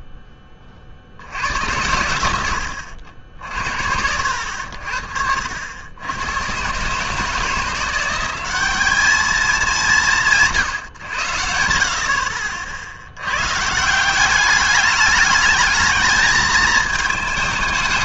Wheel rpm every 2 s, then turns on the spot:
30, 90, 70, 110, 190, 140, 60, 200, 220.
none